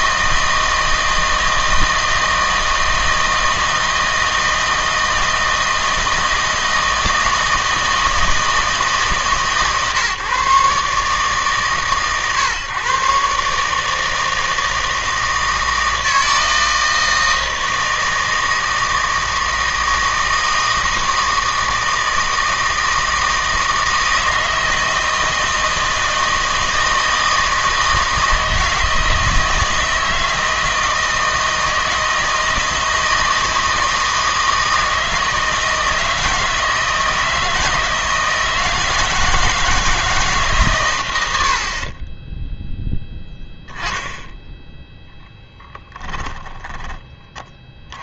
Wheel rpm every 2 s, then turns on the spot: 160, 160, 160, 160, 160, 140, 130, 160, 160, 160, 160, 160, 160, 160, 160, 160, 160, 160, 160, 160, 120, 0, 0, 10.
none